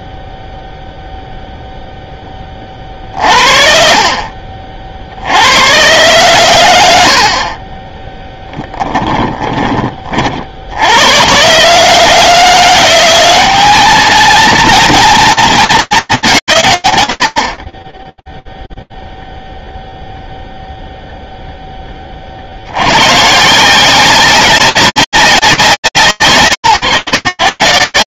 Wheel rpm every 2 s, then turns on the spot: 0, 30, 50, 100, 10, 60, 170, 230, 160, 0, 0, 80, 190, 130.
8-10